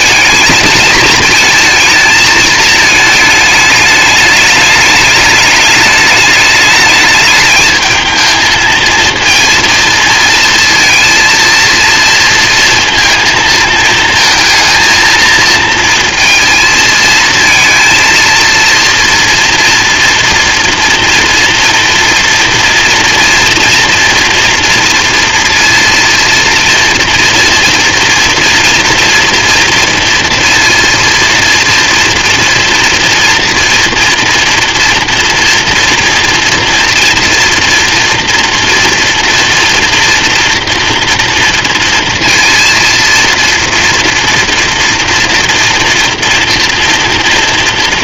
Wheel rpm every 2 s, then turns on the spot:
220, 220, 210, 210, 230, 230, 230, 230, 230, 230, 230, 240, 230, 230, 240, 230, 240, 240, 230, 230, 230, 230, 230, 230.
none